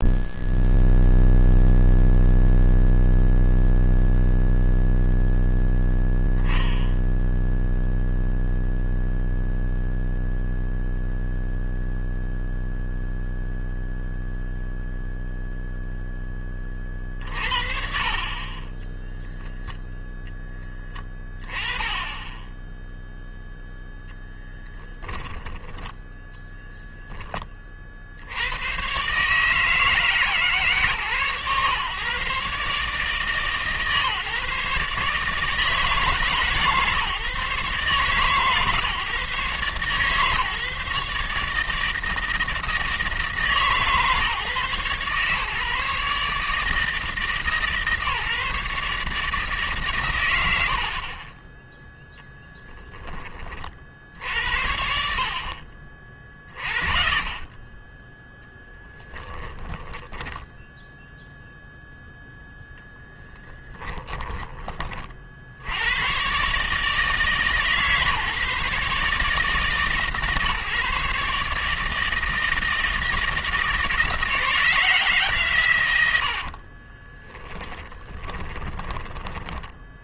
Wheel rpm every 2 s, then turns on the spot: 0, 0, 0, 10, 0, 0, 0, 0, 30, 10, 10, 0, 10, 10, 110, 140, 140, 140, 150, 130, 140, 160, 140, 150, 150, 60, 10, 70, 20, 10, 0, 10, 30, 150, 150, 150, 160, 170, 40, 20.
24-26 58-60 76-80